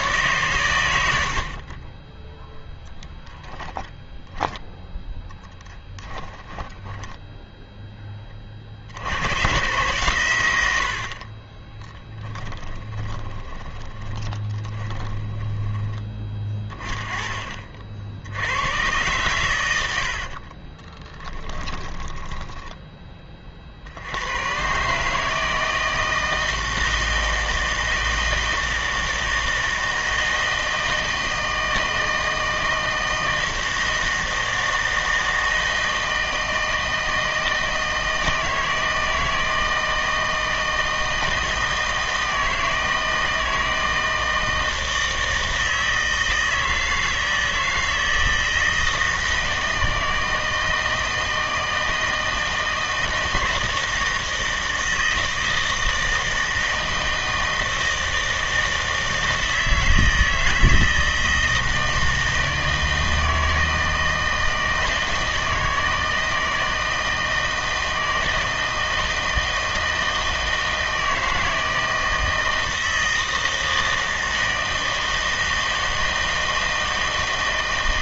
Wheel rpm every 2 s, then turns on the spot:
110, 10, 20, 10, 40, 90, 20, 20, 30, 100, 40, 10, 120, 160, 160, 160, 160, 160, 160, 160, 160, 160, 160, 160, 160, 160, 160, 160, 160, 160, 160, 160, 160, 160, 160, 160, 160, 160, 160.
2-8 12-16 20-24